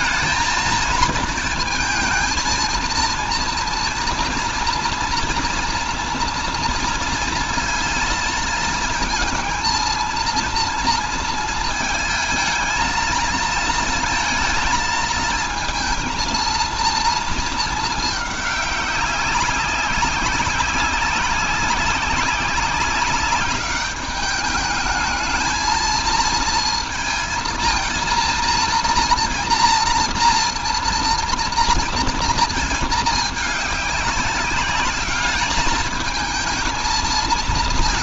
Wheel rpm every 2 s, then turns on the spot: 230, 230, 240, 230, 220, 230, 220, 230, 230, 200, 190, 190, 210, 230, 230, 230, 220, 200, 220.
none